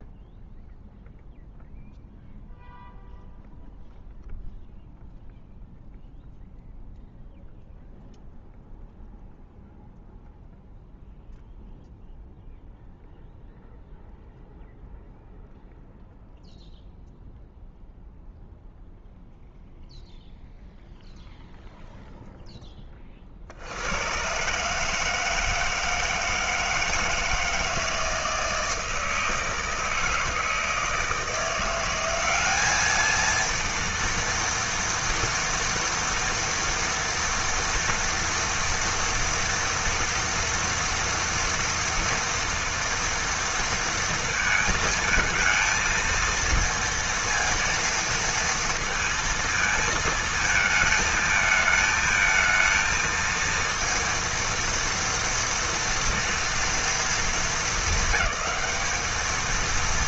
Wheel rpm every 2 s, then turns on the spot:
0, 0, 0, 0, 0, 0, 0, 0, 0, 0, 0, 10, 150, 160, 160, 160, 210, 230, 230, 230, 230, 230, 220, 230, 230, 220, 220, 230, 230, 210.
none